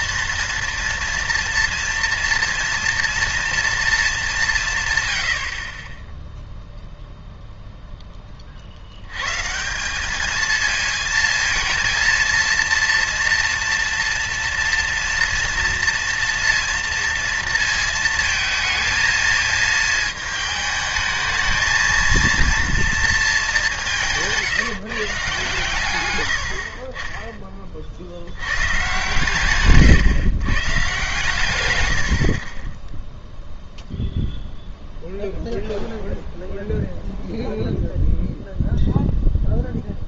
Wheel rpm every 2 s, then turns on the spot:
230, 230, 150, 0, 80, 230, 230, 230, 230, 220, 220, 230, 170, 50, 110, 140, 20, 0, 0, 0.
none